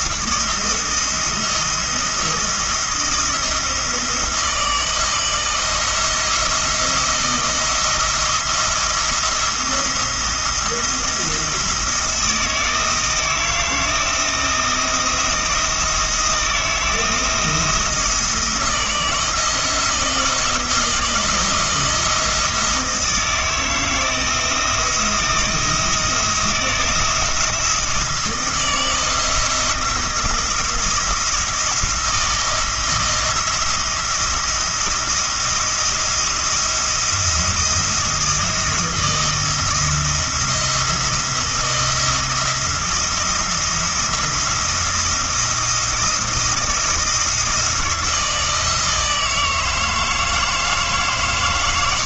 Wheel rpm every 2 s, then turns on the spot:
170, 170, 160, 170, 170, 170, 160, 170, 170, 170, 170, 160, 170, 170, 160, 170, 160, 170, 170, 170, 170, 170, 170, 170, 160, 150.
none